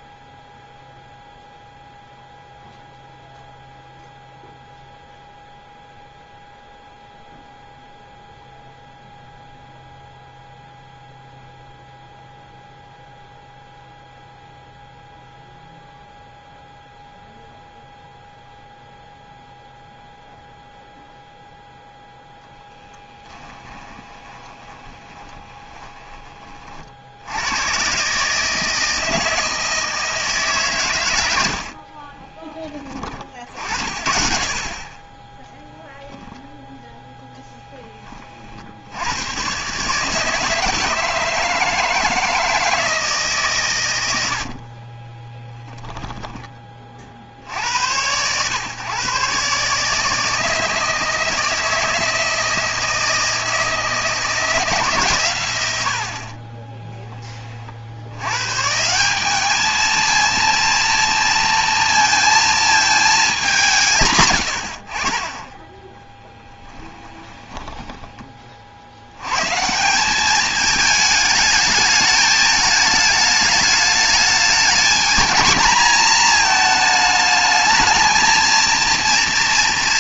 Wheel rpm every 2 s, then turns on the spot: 0, 0, 0, 0, 0, 0, 0, 0, 0, 0, 0, 0, 20, 40, 160, 140, 20, 40, 10, 60, 160, 160, 50, 40, 130, 160, 160, 160, 30, 170, 230, 220, 50, 10, 80, 220, 210, 220, 220, 230.
24-26 36-38 56-58 66-68